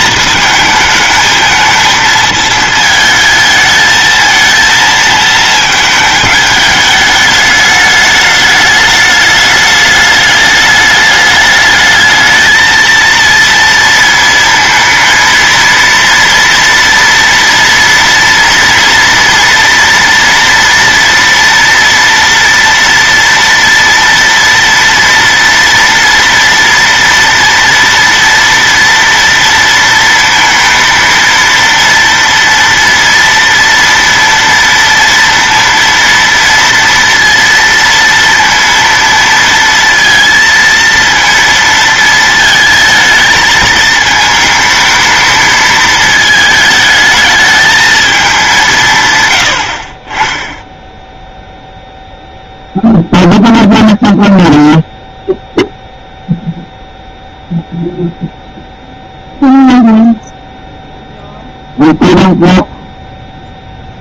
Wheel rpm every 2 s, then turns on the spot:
220, 220, 220, 210, 210, 210, 220, 230, 230, 230, 230, 230, 230, 230, 230, 230, 230, 230, 230, 230, 230, 220, 220, 220, 180, 10, 0, 0, 0, 0, 0, 0.
none